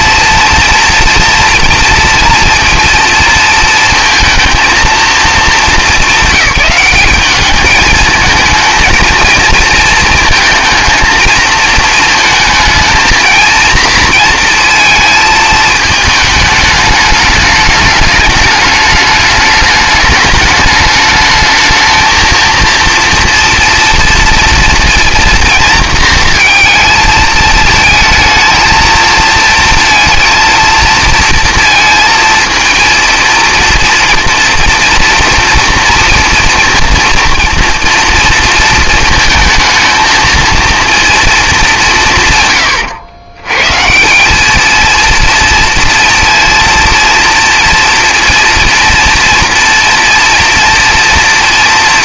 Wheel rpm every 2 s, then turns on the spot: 240, 230, 230, 190, 220, 220, 220, 230, 210, 210, 210, 230, 240, 230, 230, 230, 230, 230, 230, 230, 230, 120, 220, 230, 230, 230.
none